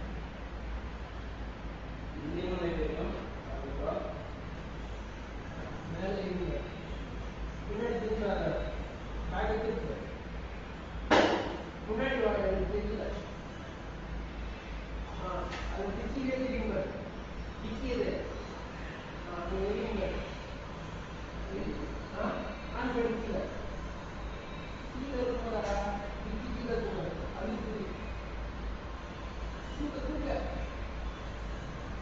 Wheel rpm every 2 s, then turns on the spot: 0, 0, 0, 0, 0, 0, 0, 0, 0, 0, 0, 0, 0, 0, 0, 0.
none